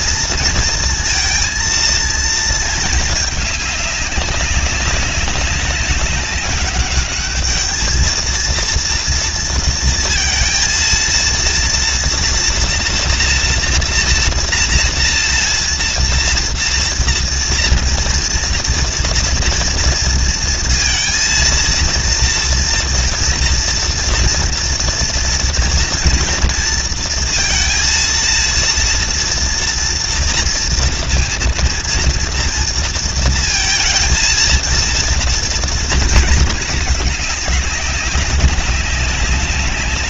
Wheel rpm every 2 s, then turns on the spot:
230, 230, 200, 200, 230, 230, 230, 240, 230, 230, 230, 230, 230, 230, 230, 230, 230, 230, 220, 190.
none